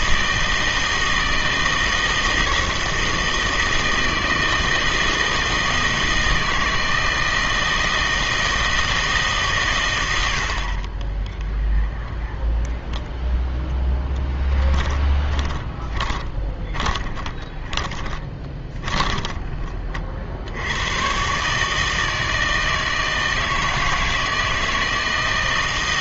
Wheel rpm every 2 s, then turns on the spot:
160, 160, 160, 160, 160, 80, 0, 10, 20, 20, 70, 160, 160.
14-20